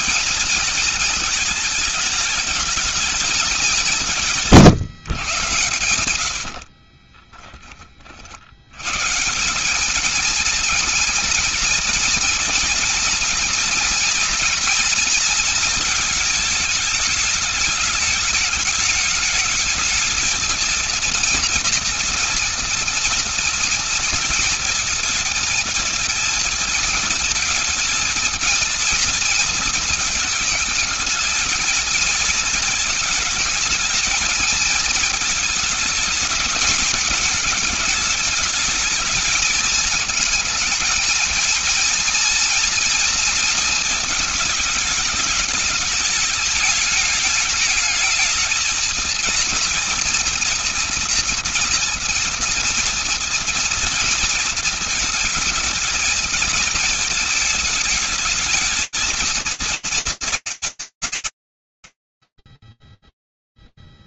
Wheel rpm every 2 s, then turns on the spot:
220, 210, 130, 50, 120, 230, 230, 230, 210, 210, 230, 240, 230, 230, 230, 220, 220, 220, 220, 220, 230, 240, 220, 220, 230, 230, 230, 230, 220, 230, 130, 0.
6-8